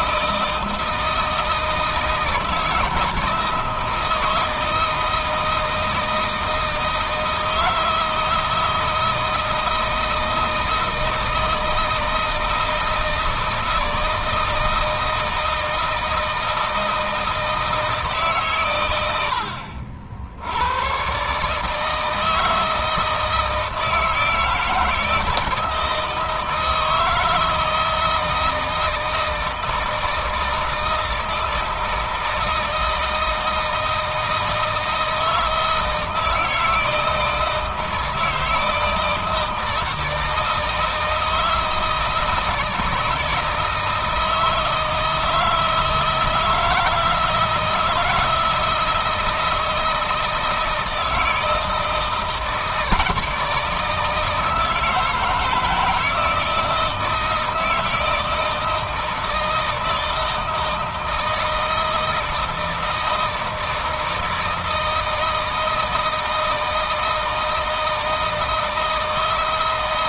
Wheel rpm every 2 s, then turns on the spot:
160, 160, 160, 160, 160, 160, 160, 160, 160, 120, 100, 160, 160, 160, 160, 160, 160, 160, 160, 160, 160, 160, 160, 160, 160, 160, 160, 160, 160, 160, 160, 160, 160, 160, 160.
none